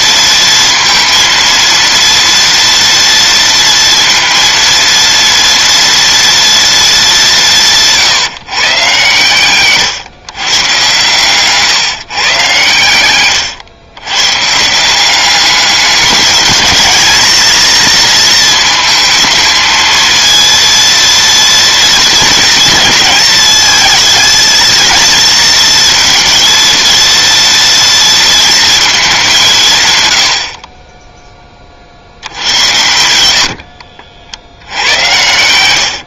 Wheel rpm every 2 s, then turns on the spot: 230, 230, 230, 220, 130, 130, 110, 150, 210, 230, 230, 230, 220, 230, 230, 50, 90, 80.
32-34